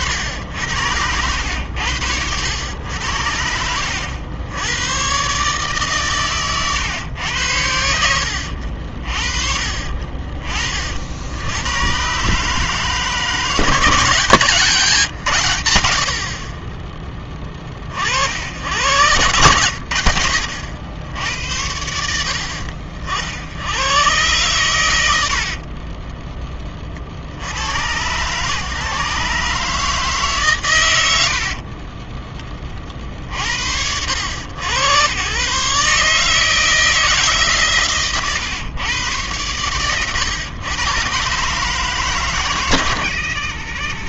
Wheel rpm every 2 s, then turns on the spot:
80, 90, 100, 120, 60, 40, 150, 150, 40, 80, 70, 60, 120, 20, 140, 130, 40, 90, 160, 120, 120, 130.
none